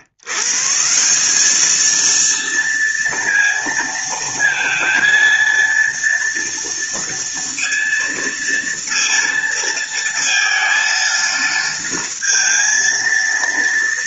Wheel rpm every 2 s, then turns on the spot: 140, 230, 230, 230, 230, 230, 230.
none